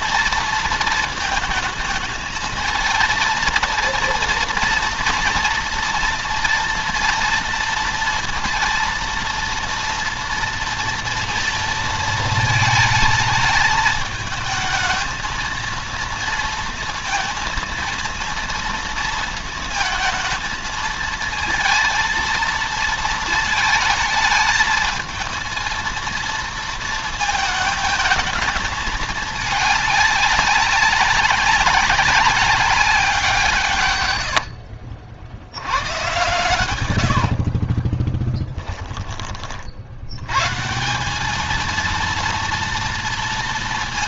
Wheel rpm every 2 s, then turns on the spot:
230, 230, 240, 230, 230, 230, 220, 220, 230, 230, 220, 230, 220, 230, 220, 200, 190, 80, 130, 10, 160, 230.
34-38